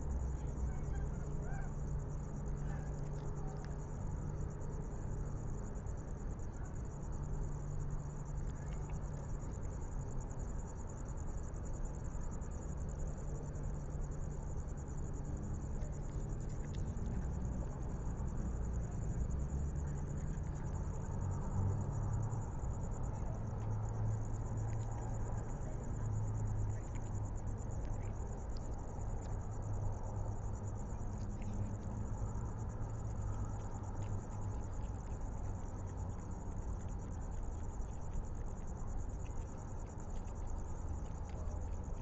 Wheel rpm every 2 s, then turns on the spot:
0, 0, 0, 0, 0, 0, 0, 0, 0, 0, 0, 0, 0, 0, 0, 0, 0, 0, 0, 0, 0.
none